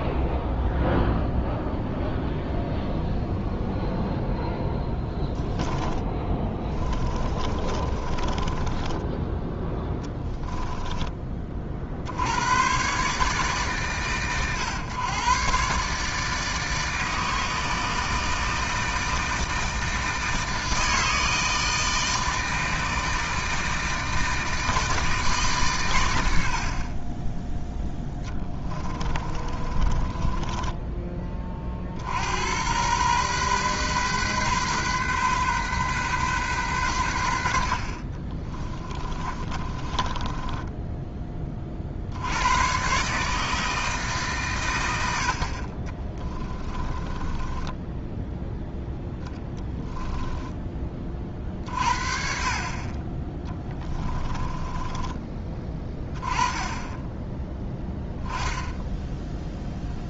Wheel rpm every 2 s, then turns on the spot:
0, 0, 0, 30, 20, 10, 120, 120, 150, 160, 160, 160, 160, 30, 20, 20, 110, 130, 110, 20, 10, 130, 100, 20, 0, 20, 30, 20, 10, 10.
6-10 28-30 38-40 46-48 54-56